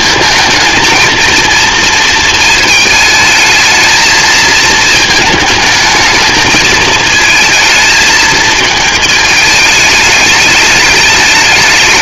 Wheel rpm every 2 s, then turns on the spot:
230, 220, 220, 220, 220, 210.
none